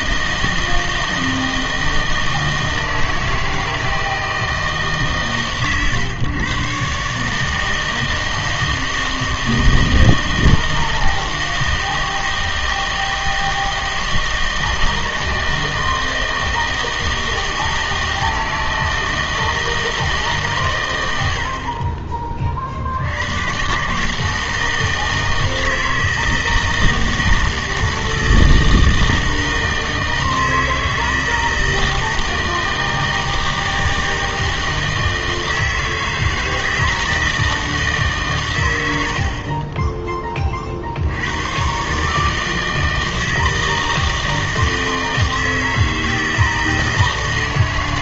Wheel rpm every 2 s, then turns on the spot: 160, 160, 160, 130, 160, 160, 160, 160, 160, 160, 120, 50, 160, 160, 160, 160, 160, 160, 160, 100, 40, 160, 160, 160.
none